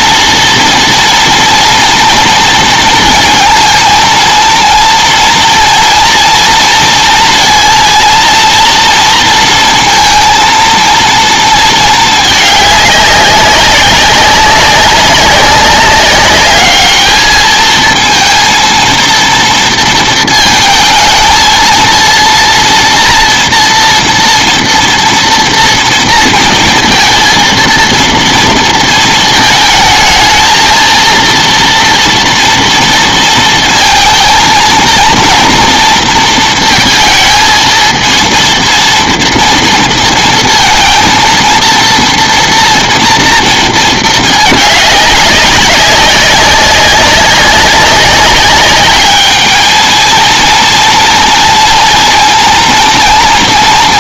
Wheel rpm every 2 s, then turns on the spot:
230, 230, 230, 230, 230, 230, 210, 190, 210, 230, 230, 230, 230, 230, 230, 220, 230, 220, 230, 230, 230, 230, 210, 190, 200, 230, 230.
none